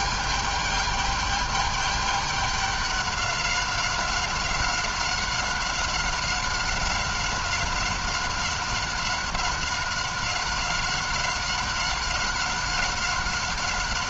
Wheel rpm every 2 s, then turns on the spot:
210, 200, 190, 190, 190, 190, 190.
none